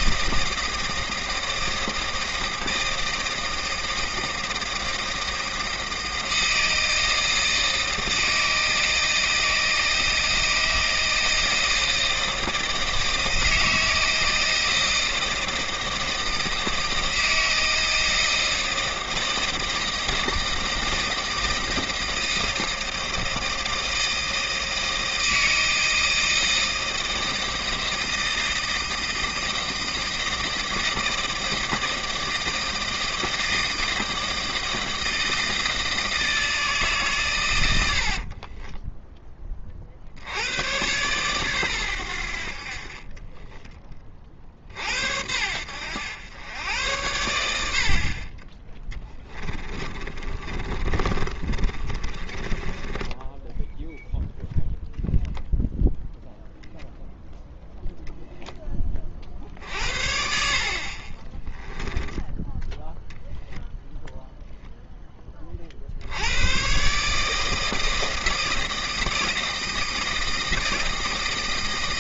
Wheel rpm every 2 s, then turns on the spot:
160, 160, 160, 160, 160, 160, 160, 160, 160, 160, 160, 160, 160, 160, 160, 160, 160, 160, 160, 20, 100, 60, 50, 90, 20, 40, 20, 0, 0, 10, 50, 10, 0, 110, 160, 160.
38-40 50-54